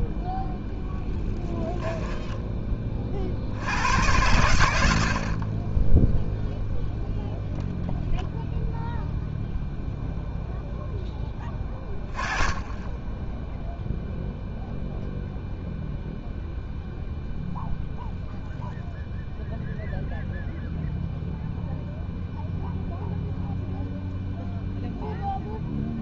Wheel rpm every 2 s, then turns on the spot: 10, 20, 100, 0, 0, 0, 20, 0, 0, 0, 0, 0, 0.
none